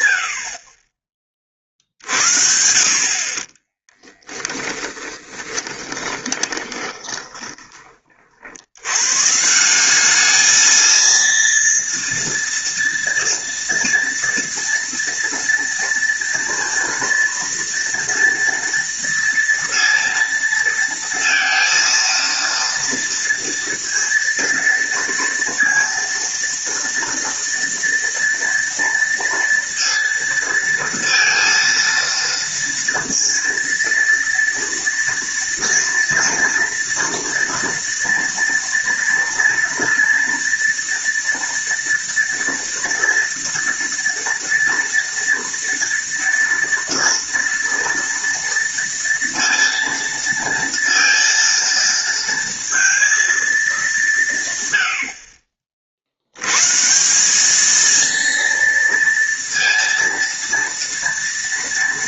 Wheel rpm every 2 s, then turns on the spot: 40, 50, 30, 20, 100, 220, 230, 230, 230, 230, 230, 230, 230, 230, 230, 230, 230, 230, 230, 230, 230, 230, 230, 230, 230, 230, 230, 100, 150, 230, 230.
4-8